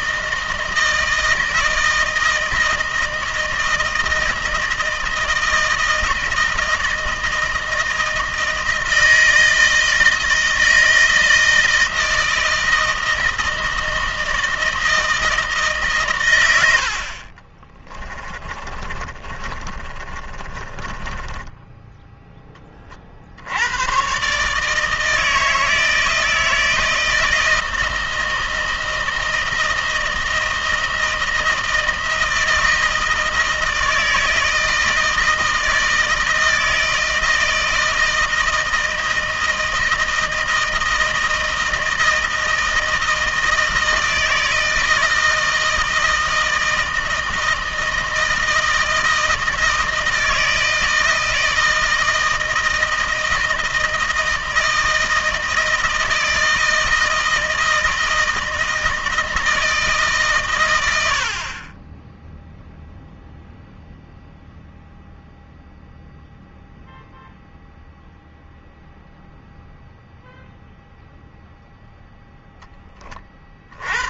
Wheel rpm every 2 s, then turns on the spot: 160, 160, 160, 160, 160, 160, 160, 160, 60, 30, 30, 40, 150, 160, 160, 160, 160, 160, 160, 160, 160, 160, 160, 160, 160, 160, 160, 160, 160, 160, 90, 0, 0, 0, 0, 0, 20.
18-22